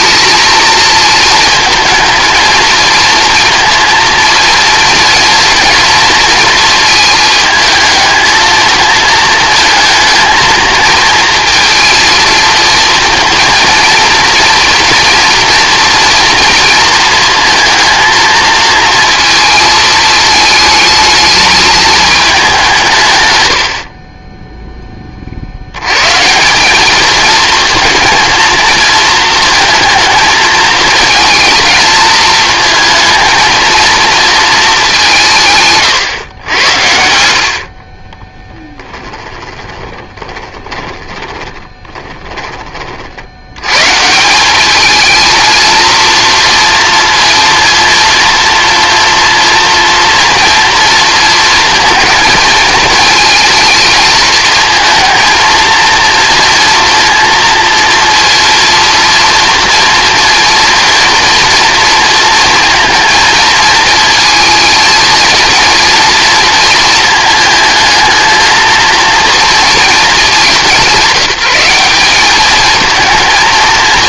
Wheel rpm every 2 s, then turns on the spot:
220, 230, 240, 230, 220, 220, 230, 240, 230, 230, 220, 170, 10, 200, 230, 220, 220, 190, 80, 10, 20, 40, 210, 230, 230, 230, 220, 220, 230, 230, 230, 230, 230, 230, 230, 180, 220.
38-42